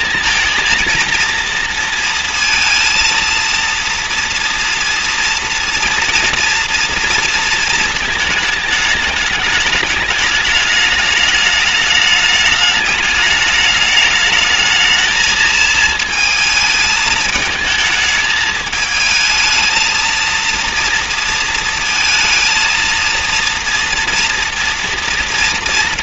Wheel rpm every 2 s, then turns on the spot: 230, 230, 230, 230, 220, 210, 210, 220, 220, 220, 230, 220, 230.
none